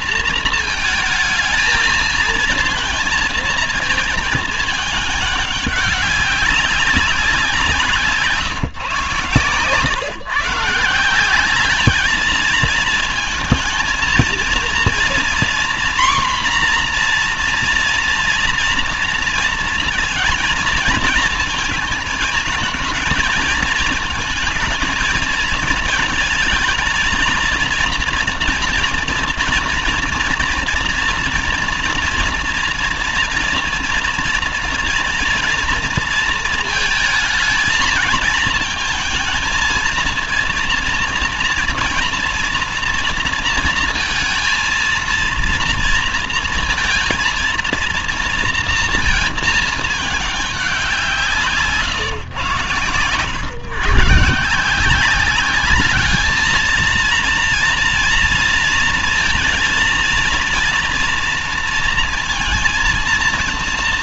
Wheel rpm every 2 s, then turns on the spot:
230, 230, 210, 200, 150, 160, 220, 230, 240, 230, 220, 230, 220, 220, 240, 230, 230, 230, 220, 220, 230, 230, 230, 230, 230, 200, 120, 170, 220, 230, 230, 230.
none